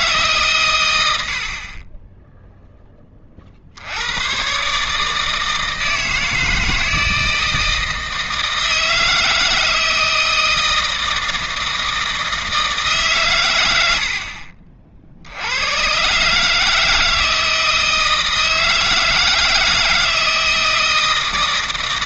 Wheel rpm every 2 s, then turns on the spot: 120, 10, 140, 160, 160, 160, 160, 50, 150, 160, 160.
none